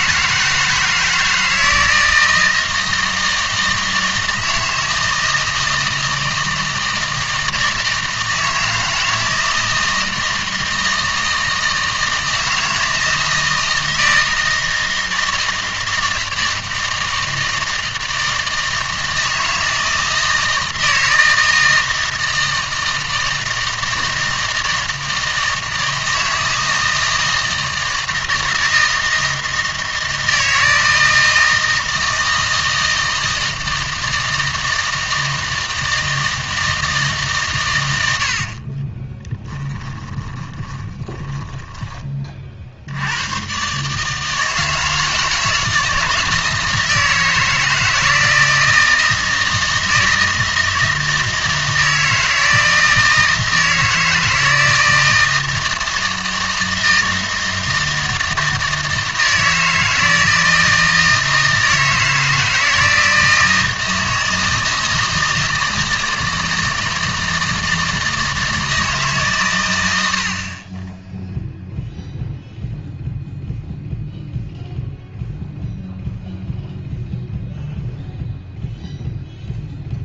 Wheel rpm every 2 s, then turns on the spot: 160, 160, 160, 160, 160, 160, 160, 160, 160, 160, 160, 160, 160, 160, 160, 160, 160, 160, 160, 40, 20, 60, 160, 160, 160, 160, 160, 160, 160, 160, 160, 160, 160, 160, 160, 40, 0, 0, 0, 0.
38-42